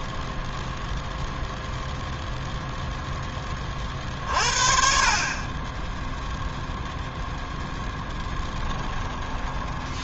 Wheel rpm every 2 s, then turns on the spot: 0, 0, 40, 0, 10.
8-10